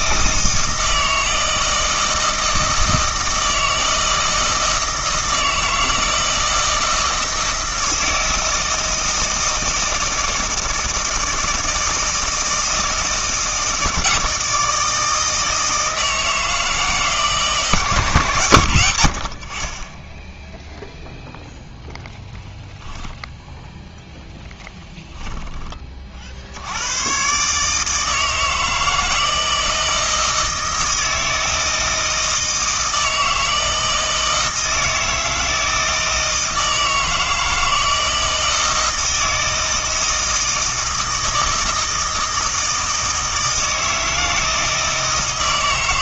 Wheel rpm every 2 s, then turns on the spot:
160, 160, 160, 160, 160, 160, 160, 160, 160, 110, 0, 0, 10, 90, 160, 160, 160, 160, 160, 160, 160, 160, 160.
24-26